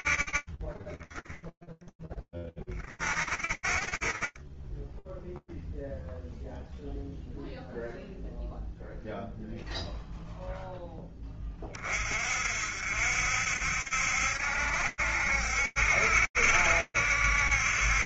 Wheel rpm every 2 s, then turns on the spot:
20, 30, 0, 0, 0, 50, 70, 70, 60.
none